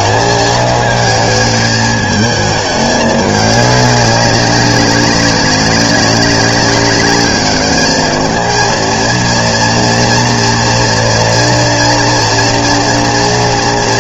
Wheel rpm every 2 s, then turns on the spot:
220, 210, 190, 200, 220, 230, 230.
none